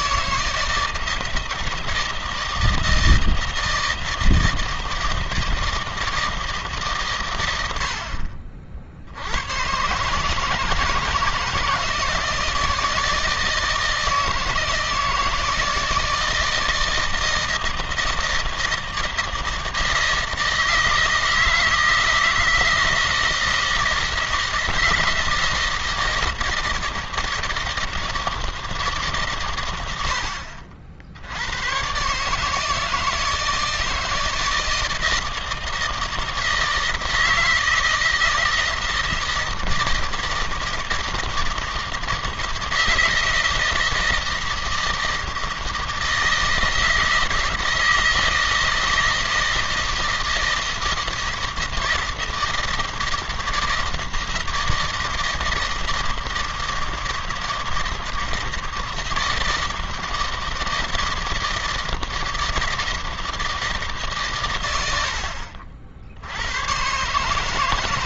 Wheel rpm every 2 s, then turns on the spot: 160, 160, 160, 150, 60, 160, 160, 160, 160, 160, 160, 160, 160, 160, 150, 70, 150, 160, 160, 160, 160, 160, 160, 160, 160, 160, 160, 160, 160, 160, 160, 160, 100, 110.
none